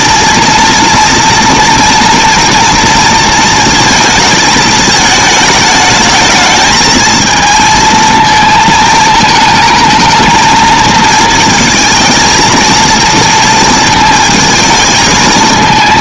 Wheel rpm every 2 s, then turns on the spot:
230, 230, 220, 220, 220, 230, 230, 220.
none